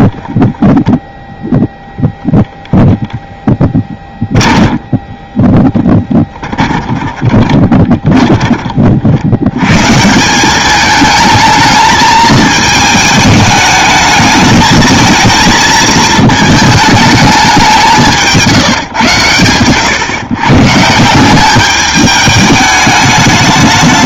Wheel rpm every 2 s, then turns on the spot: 0, 10, 10, 20, 30, 210, 210, 220, 220, 140, 150, 210.
4-8